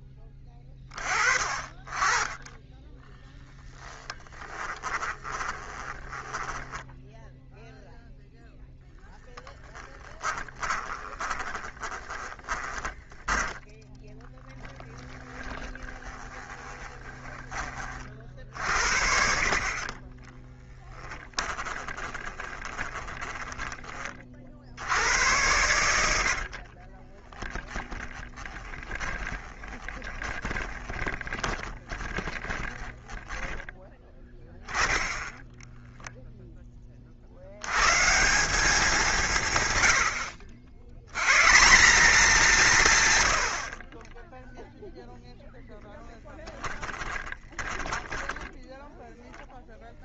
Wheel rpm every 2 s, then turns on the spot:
30, 10, 10, 10, 0, 10, 10, 0, 20, 50, 10, 20, 60, 40, 10, 20, 10, 10, 30, 180, 90, 160, 0, 20, 0.
2-6 10-14 16-18 20-24 26-34 46-48